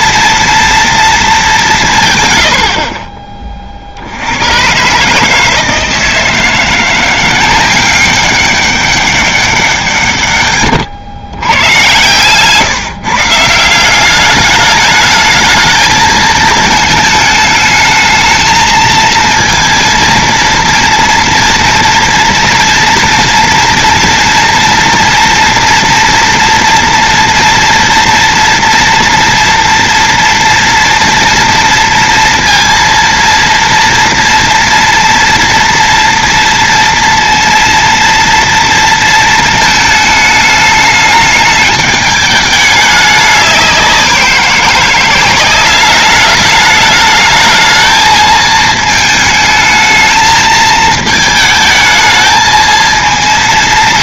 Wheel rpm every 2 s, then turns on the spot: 230, 130, 90, 160, 190, 130, 120, 200, 220, 220, 230, 230, 230, 240, 230, 240, 230, 230, 230, 230, 220, 210, 180, 210, 220, 220, 220.
10-12